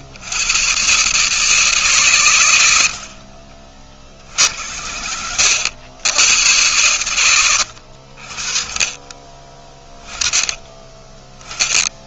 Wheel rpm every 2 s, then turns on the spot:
110, 100, 60, 100, 40, 20.
4-6